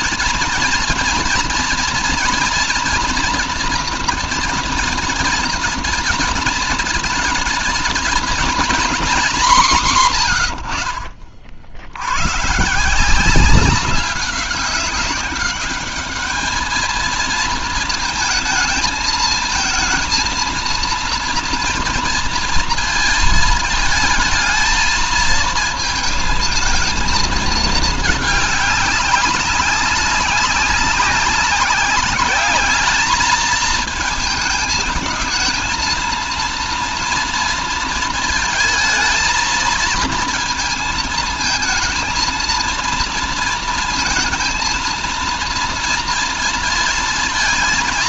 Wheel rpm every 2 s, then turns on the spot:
230, 240, 230, 220, 230, 90, 160, 190, 220, 220, 230, 230, 220, 220, 200, 200, 210, 220, 240, 220, 220, 230, 230, 230.
none